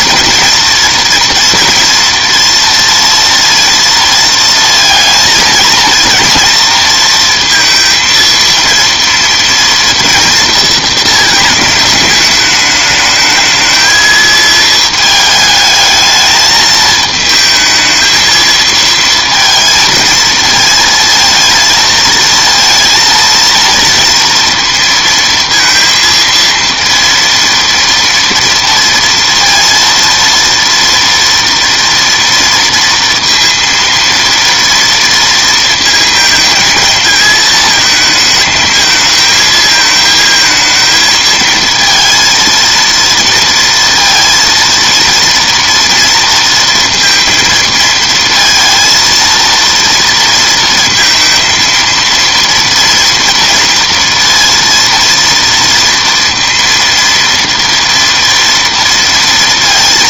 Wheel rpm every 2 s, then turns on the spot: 230, 240, 230, 230, 230, 230, 210, 220, 220, 220, 220, 230, 230, 230, 230, 230, 230, 230, 220, 220, 220, 230, 230, 230, 230, 230, 230, 230, 230, 230.
none